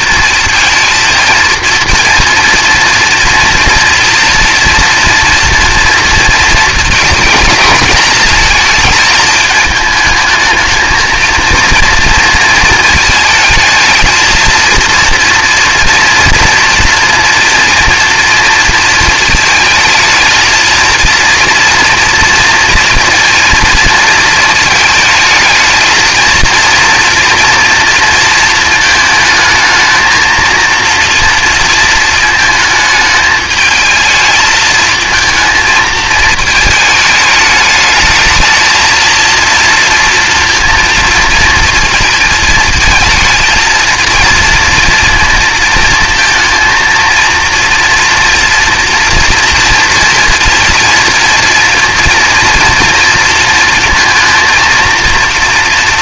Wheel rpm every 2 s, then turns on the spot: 230, 230, 230, 220, 210, 220, 220, 230, 240, 230, 230, 230, 220, 240, 220, 230, 220, 220, 220, 230, 230, 220, 230, 230, 240, 230, 230, 230.
none